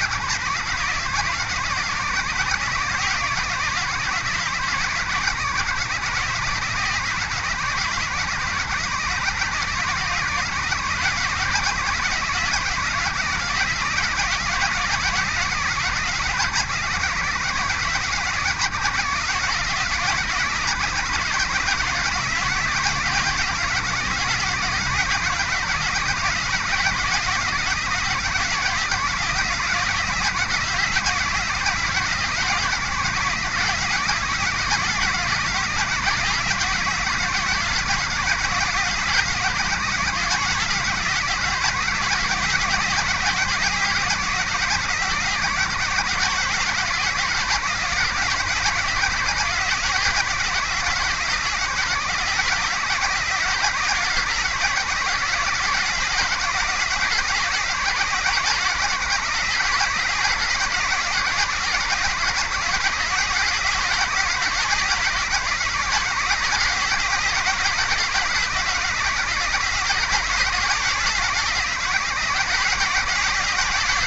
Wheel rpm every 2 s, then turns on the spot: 90, 90, 90, 90, 90, 100, 110, 110, 100, 110, 110, 120, 130, 120, 130, 130, 130, 140, 130, 130, 130, 130, 130, 130, 120, 130, 130, 130, 130, 140, 140, 130, 130, 130, 130, 140, 130.
none